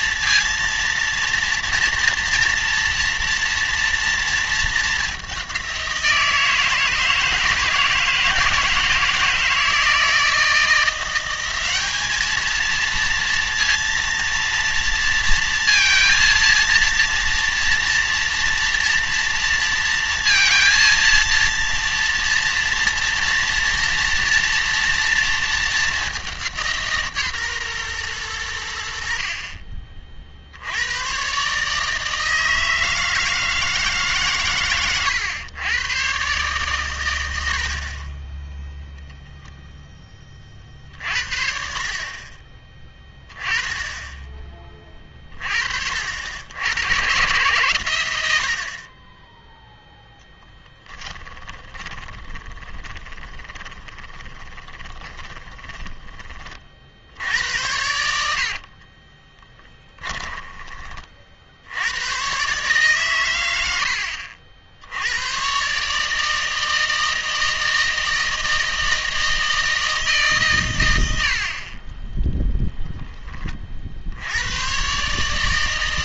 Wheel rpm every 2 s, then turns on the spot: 230, 230, 210, 160, 160, 170, 230, 230, 230, 230, 230, 230, 230, 160, 70, 90, 160, 120, 130, 0, 50, 20, 30, 110, 40, 20, 20, 20, 60, 40, 30, 130, 80, 160, 160, 120, 0, 120.
50-56 58-62